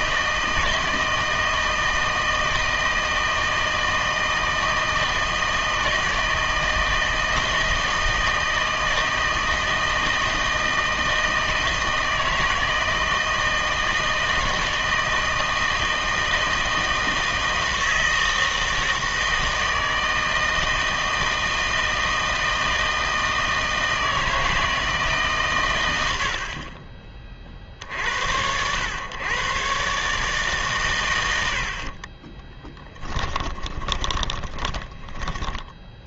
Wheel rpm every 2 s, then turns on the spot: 160, 160, 160, 160, 160, 160, 160, 160, 160, 160, 160, 160, 160, 40, 100, 140, 10, 20.
32-36